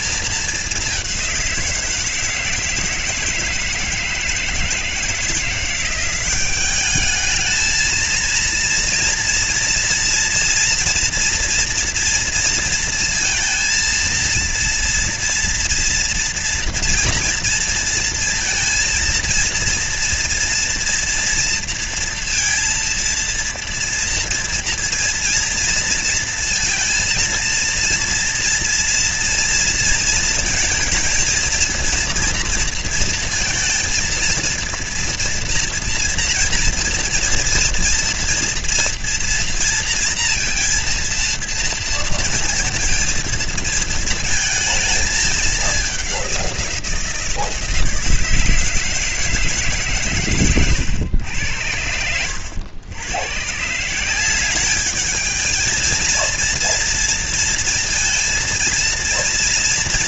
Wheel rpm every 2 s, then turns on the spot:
210, 160, 160, 200, 230, 240, 230, 230, 240, 230, 230, 230, 230, 230, 240, 230, 230, 230, 240, 230, 230, 230, 220, 180, 160, 120, 100, 200, 230, 230.
none